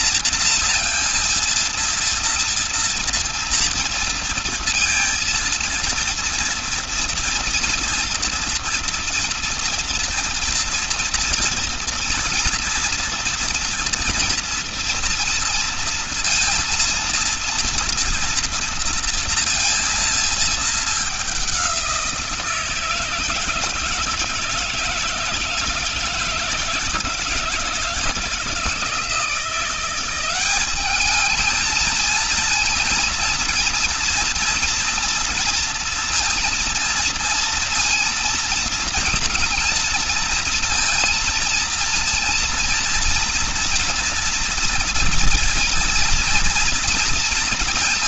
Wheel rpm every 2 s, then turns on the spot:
230, 230, 230, 230, 230, 240, 230, 230, 230, 230, 210, 170, 160, 160, 160, 200, 230, 230, 230, 230, 230, 230, 230, 230.
none